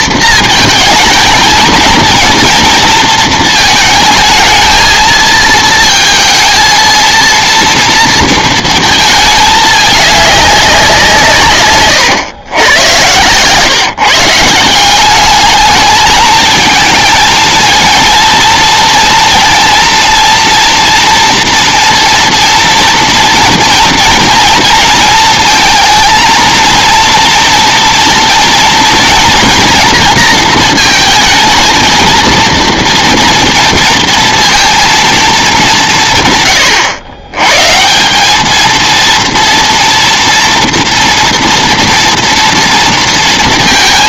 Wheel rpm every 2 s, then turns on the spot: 220, 230, 220, 230, 220, 190, 100, 170, 220, 230, 230, 230, 230, 230, 230, 230, 230, 230, 120, 220, 240, 230.
none